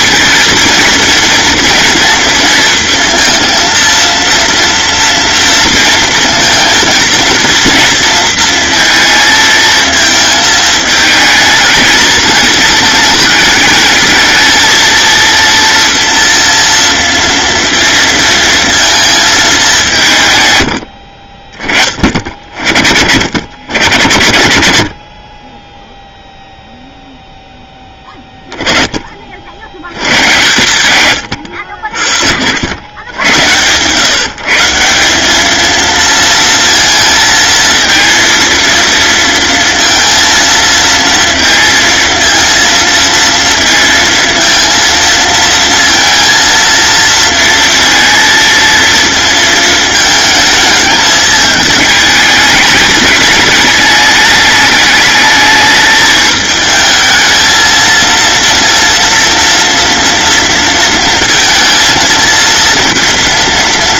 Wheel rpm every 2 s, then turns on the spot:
230, 230, 230, 230, 230, 220, 220, 230, 230, 230, 130, 60, 110, 0, 20, 110, 70, 160, 230, 230, 230, 230, 230, 230, 230, 220, 210, 220, 220, 230, 230, 230.
none